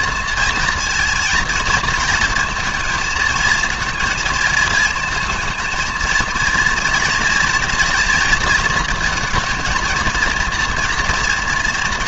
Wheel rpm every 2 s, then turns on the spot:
230, 220, 230, 230, 230, 230.
none